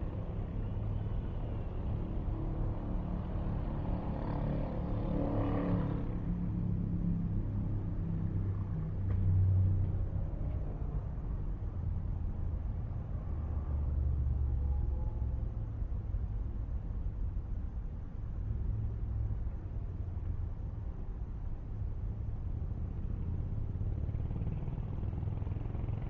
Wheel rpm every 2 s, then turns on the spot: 0, 0, 0, 0, 0, 0, 0, 0, 0, 0, 0, 0, 0.
none